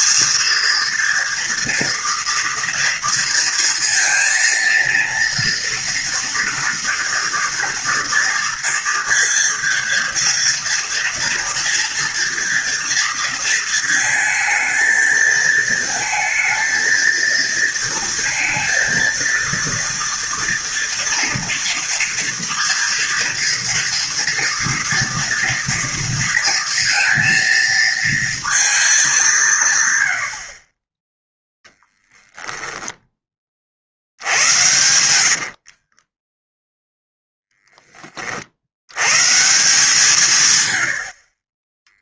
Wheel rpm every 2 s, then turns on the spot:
230, 230, 230, 230, 230, 230, 230, 220, 230, 230, 230, 230, 230, 230, 220, 40, 0, 100, 0, 70, 90.
34-36